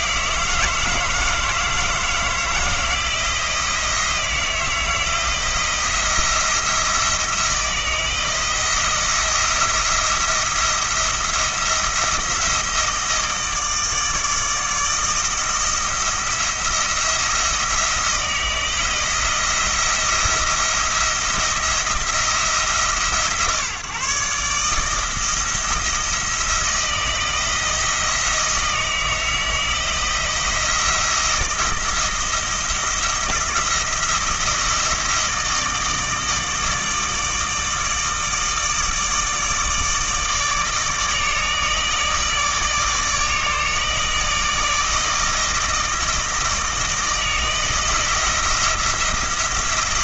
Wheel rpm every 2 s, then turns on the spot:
160, 170, 160, 170, 160, 170, 160, 160, 170, 170, 170, 150, 150, 170, 160, 170, 170, 160, 160, 160, 160, 150, 160, 160, 170.
none